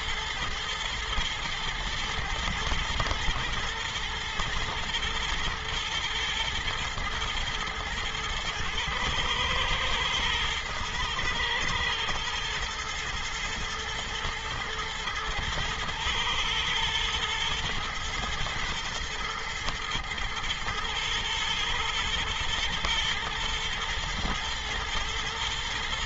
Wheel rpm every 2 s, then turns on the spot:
120, 110, 120, 120, 110, 120, 120, 110, 110, 120, 110, 110, 110.
none